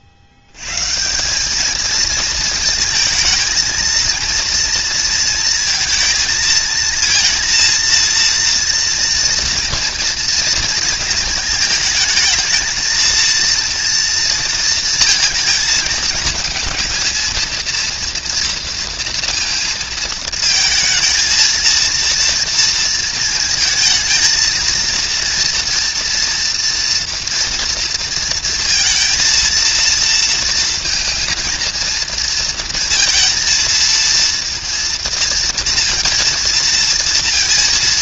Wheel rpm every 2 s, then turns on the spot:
80, 220, 230, 220, 230, 230, 220, 230, 220, 230, 220, 230, 230, 230, 230, 230, 230, 230, 230.
none